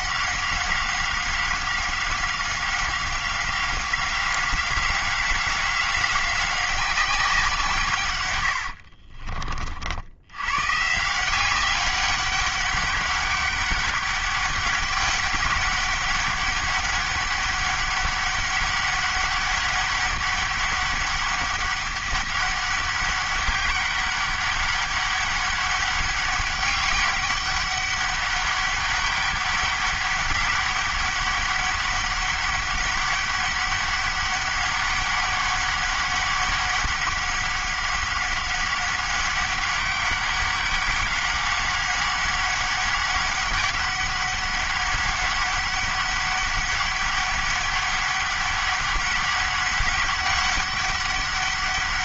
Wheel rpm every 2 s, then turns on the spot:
190, 190, 180, 190, 90, 120, 200, 200, 200, 200, 200, 200, 200, 200, 200, 200, 200, 200, 200, 190, 200, 200, 200, 200, 200, 200.
8-10